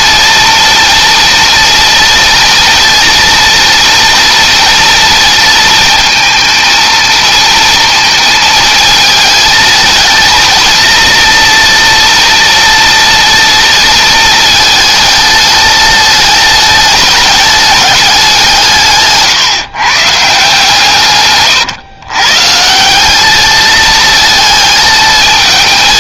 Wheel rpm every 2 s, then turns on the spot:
230, 230, 230, 230, 220, 230, 230, 220, 210, 170, 150, 160, 220.
none